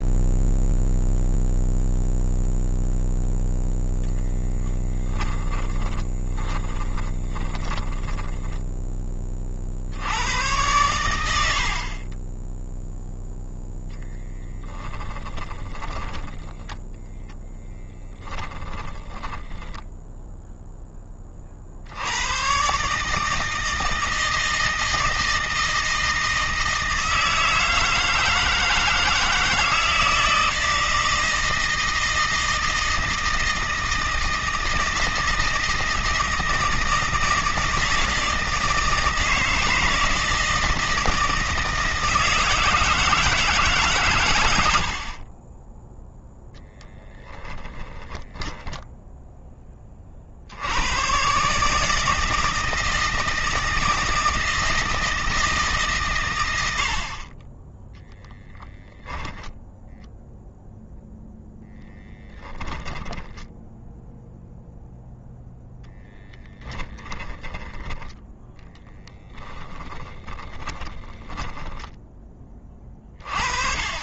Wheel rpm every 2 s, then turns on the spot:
0, 0, 10, 10, 20, 100, 0, 10, 10, 10, 20, 140, 160, 160, 160, 160, 160, 160, 160, 160, 160, 160, 50, 10, 0, 90, 160, 160, 80, 10, 0, 10, 0, 10, 10, 10, 30.
4-8 14-16 18-20 62-64 66-72